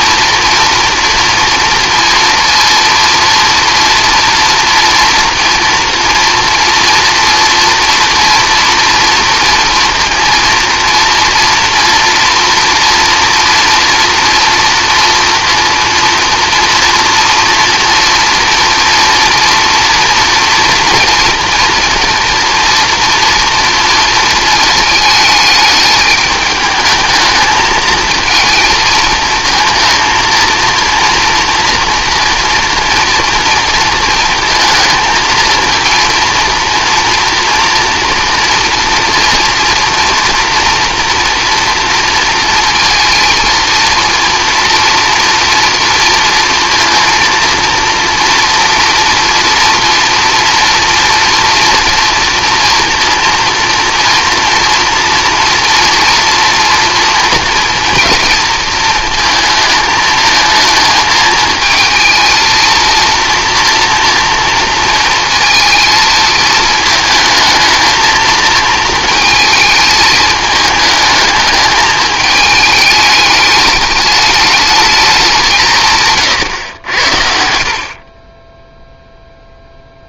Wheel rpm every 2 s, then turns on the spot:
240, 230, 230, 230, 240, 230, 230, 230, 230, 230, 230, 230, 220, 210, 230, 230, 230, 220, 240, 240, 230, 230, 230, 230, 230, 240, 230, 230, 230, 230, 220, 230, 230, 220, 220, 210, 210, 210, 100, 0.
none